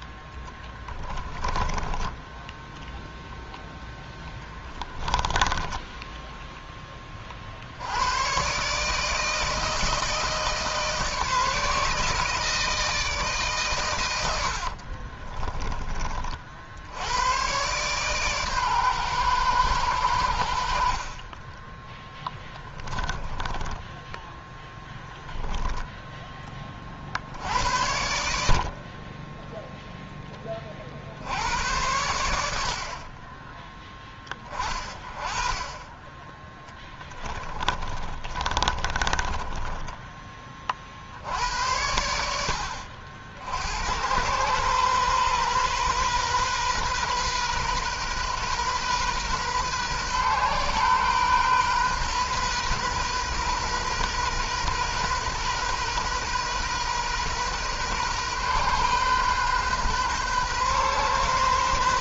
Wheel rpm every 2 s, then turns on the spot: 10, 10, 20, 10, 130, 160, 160, 60, 60, 130, 70, 10, 10, 30, 60, 30, 70, 20, 10, 30, 40, 60, 120, 130, 130, 130, 130, 120, 130, 130, 130.
0-6 14-16 22-24 36-40